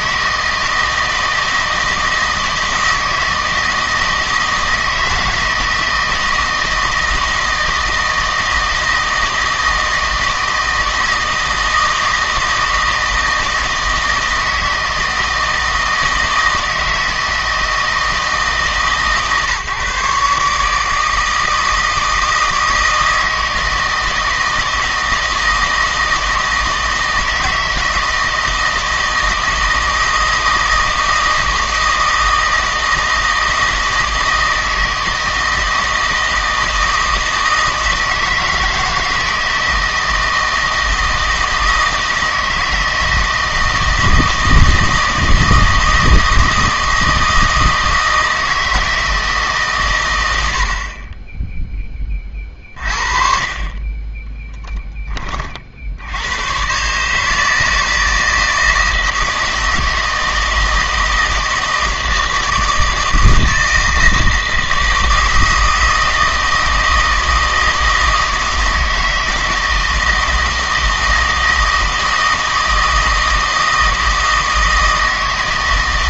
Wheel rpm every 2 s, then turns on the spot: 160, 160, 160, 160, 160, 160, 160, 160, 160, 150, 160, 160, 160, 160, 160, 160, 160, 160, 160, 160, 160, 160, 160, 160, 160, 70, 40, 10, 130, 160, 160, 160, 160, 160, 160, 160, 160, 160.
none